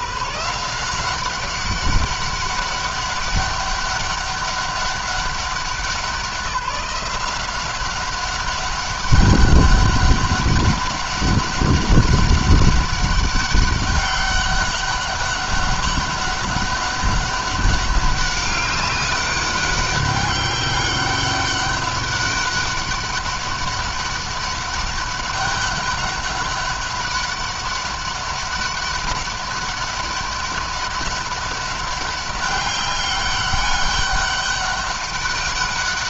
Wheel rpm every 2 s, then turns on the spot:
180, 200, 200, 180, 200, 200, 200, 200, 200, 200, 190, 200, 200, 200, 200, 200, 200, 200.
none